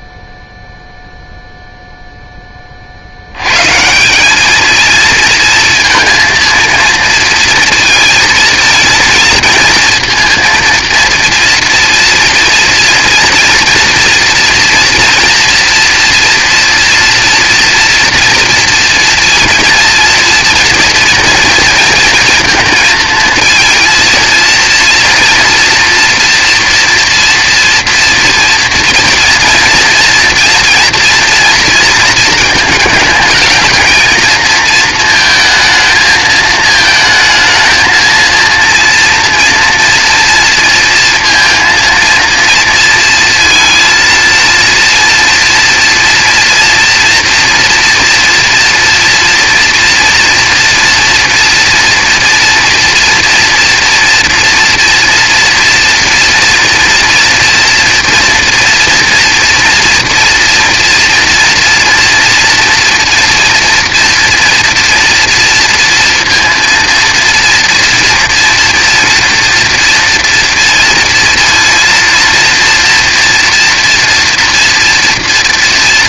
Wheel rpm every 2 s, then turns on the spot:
0, 50, 220, 230, 230, 230, 230, 230, 230, 230, 230, 220, 230, 240, 230, 230, 220, 220, 220, 230, 230, 230, 230, 230, 230, 230, 230, 240, 230, 230, 230, 230, 230, 230, 230, 230, 230, 230.
none